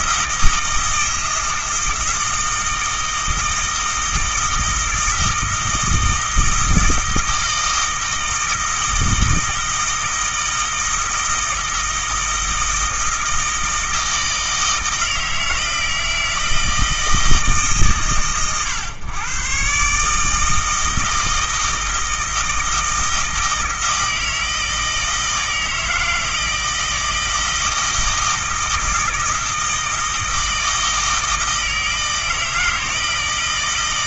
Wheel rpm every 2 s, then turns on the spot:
160, 160, 160, 160, 160, 160, 160, 160, 160, 120, 160, 160, 160, 160, 160, 160, 160.
none